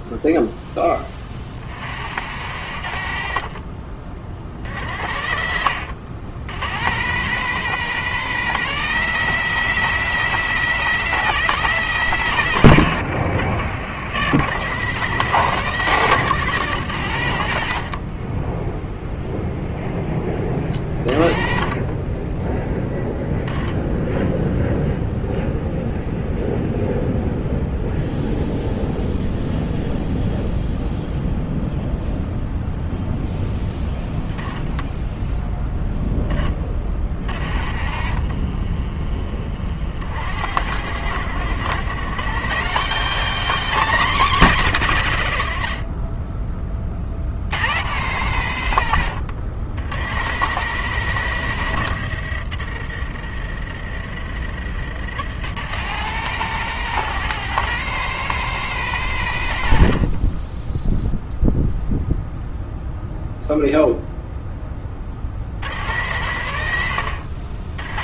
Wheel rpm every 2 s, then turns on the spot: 10, 50, 60, 100, 150, 150, 100, 130, 120, 0, 40, 10, 0, 0, 0, 0, 0, 10, 30, 40, 80, 220, 200, 40, 90, 130, 70, 90, 150, 130, 0, 0, 30, 80.
38-40